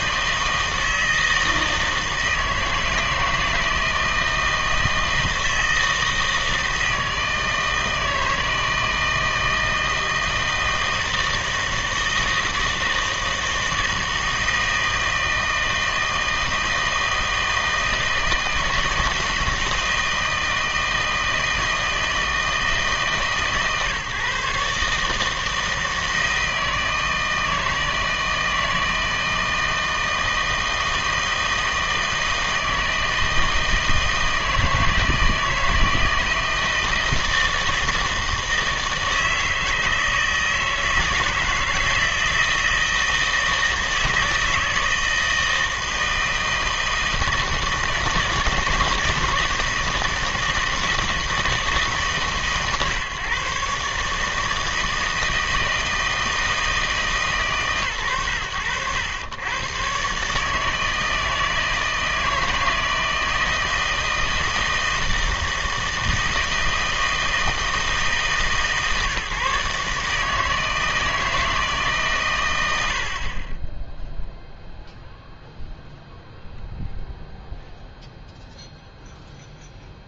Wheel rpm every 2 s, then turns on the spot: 160, 160, 160, 160, 160, 160, 160, 160, 160, 160, 160, 160, 140, 160, 160, 160, 160, 160, 160, 160, 160, 160, 160, 160, 160, 160, 140, 160, 160, 100, 160, 160, 160, 160, 150, 160, 90, 0, 0, 0.
none